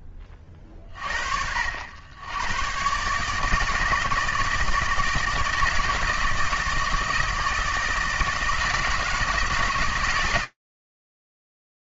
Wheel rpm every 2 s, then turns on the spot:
40, 140, 160, 160, 160, 160.
none